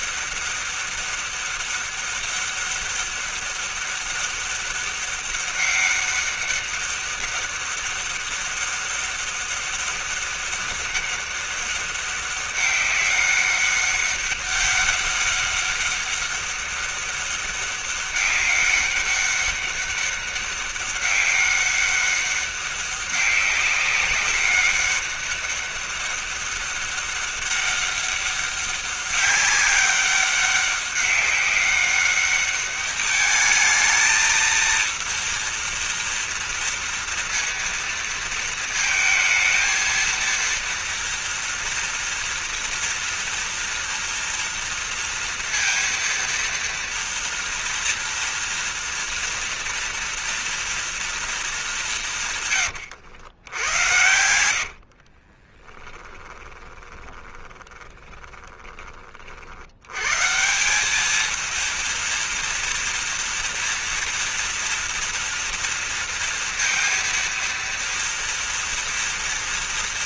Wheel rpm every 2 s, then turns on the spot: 200, 200, 200, 200, 200, 200, 200, 200, 200, 200, 200, 200, 190, 200, 200, 200, 200, 220, 240, 230, 230, 230, 230, 230, 230, 230, 180, 80, 20, 20, 130, 230, 230, 230, 230.
54-60